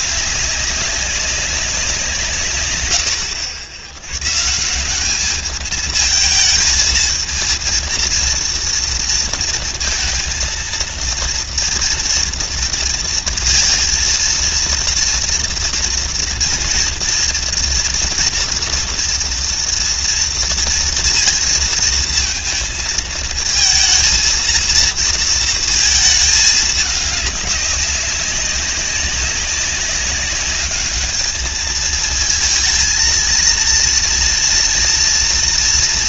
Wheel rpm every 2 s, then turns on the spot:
200, 120, 160, 220, 230, 230, 230, 230, 230, 240, 230, 230, 230, 210, 190, 200, 220, 230.
none